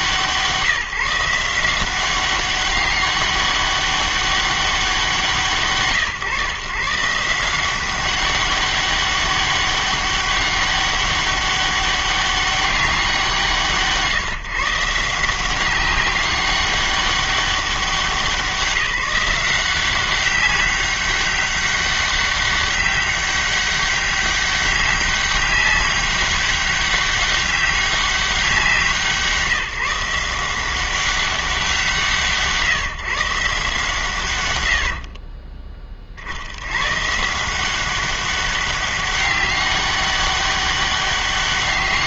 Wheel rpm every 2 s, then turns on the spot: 160, 200, 190, 130, 200, 200, 200, 150, 200, 180, 200, 200, 200, 200, 180, 180, 160, 100, 90, 190, 200.
none